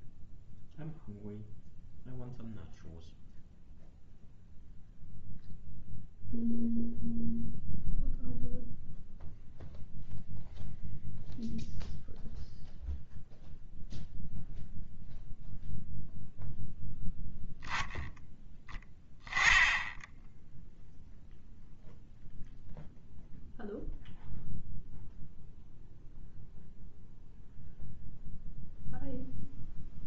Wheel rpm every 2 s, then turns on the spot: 0, 0, 0, 0, 0, 0, 0, 0, 0, 0, 0, 0, 0, 0, 0.
none